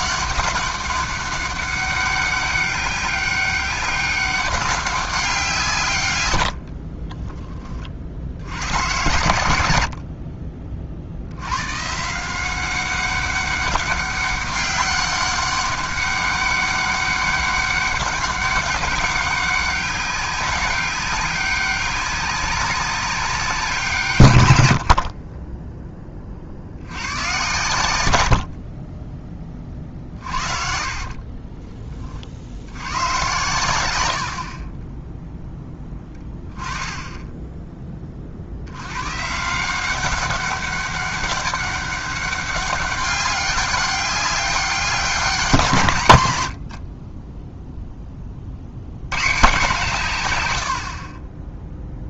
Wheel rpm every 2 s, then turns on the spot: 200, 200, 190, 60, 100, 50, 190, 200, 200, 200, 200, 200, 80, 70, 40, 50, 90, 30, 10, 90, 200, 200, 200, 90, 70, 80.
6-8 30-32 36-38 46-48